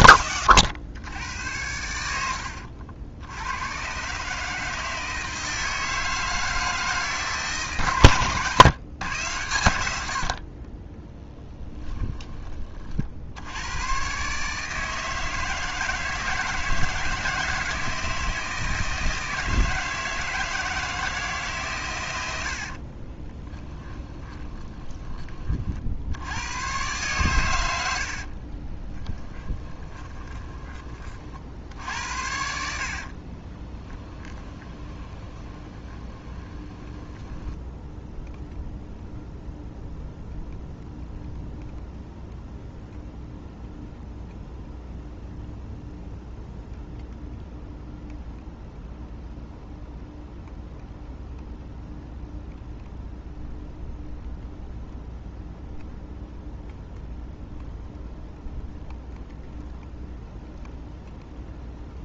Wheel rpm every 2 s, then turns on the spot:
90, 70, 160, 160, 130, 10, 50, 160, 160, 160, 160, 40, 20, 110, 30, 30, 60, 20, 20, 0, 0, 0, 0, 0, 0, 0, 0, 0, 0, 0, 0.
10-12 22-26 28-30 32-38